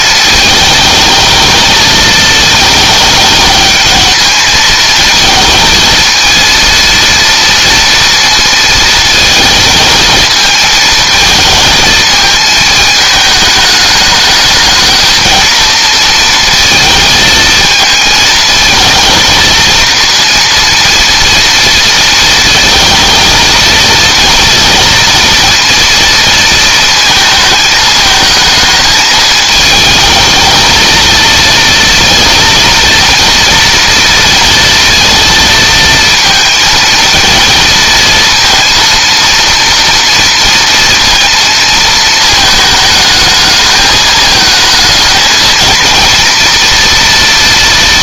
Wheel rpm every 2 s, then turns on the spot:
220, 220, 220, 230, 220, 220, 220, 220, 230, 230, 230, 230, 230, 230, 220, 220, 230, 230, 230, 230, 230, 220, 220, 230.
none